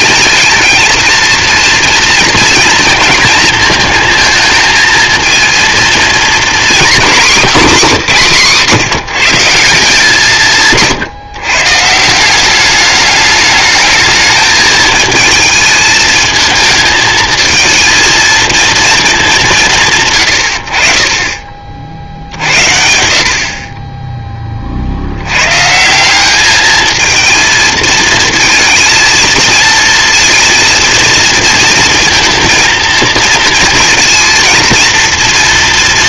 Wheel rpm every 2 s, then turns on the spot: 220, 230, 220, 240, 180, 160, 190, 220, 220, 230, 80, 80, 30, 210, 220, 230, 230, 230.
none